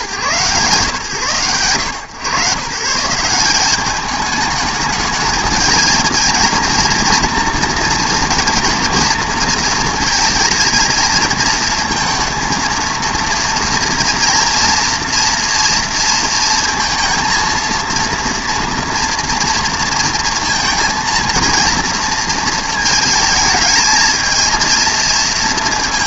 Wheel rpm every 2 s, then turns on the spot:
120, 100, 210, 230, 240, 230, 230, 230, 230, 230, 230, 230, 230.
none